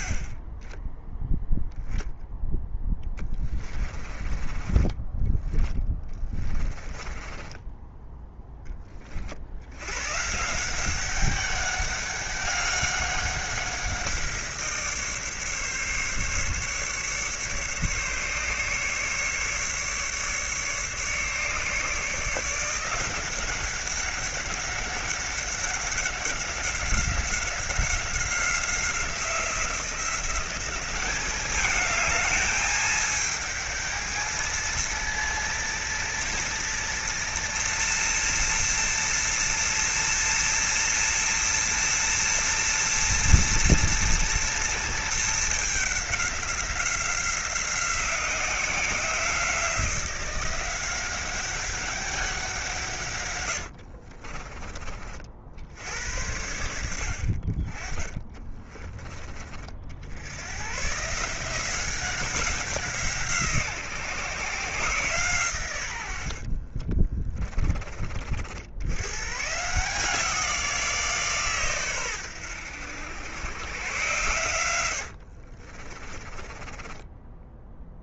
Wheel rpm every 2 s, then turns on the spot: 10, 20, 20, 20, 20, 180, 190, 160, 140, 150, 150, 180, 190, 190, 180, 200, 210, 230, 230, 230, 230, 230, 230, 180, 180, 180, 150, 40, 80, 30, 130, 170, 140, 30, 100, 170, 90, 80, 20.
2-8 58-60 66-68 74-78